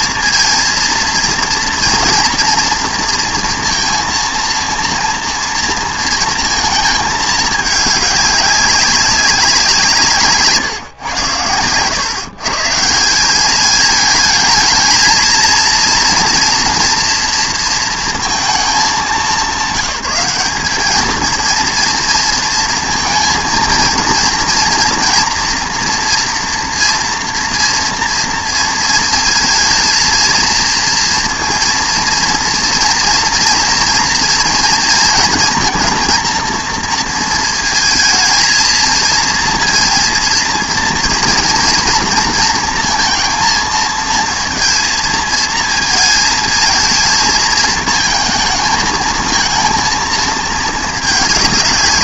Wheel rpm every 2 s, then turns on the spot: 230, 230, 230, 230, 200, 160, 140, 220, 230, 230, 190, 230, 230, 230, 230, 230, 230, 230, 230, 230, 230, 230, 230, 220, 220, 220.
none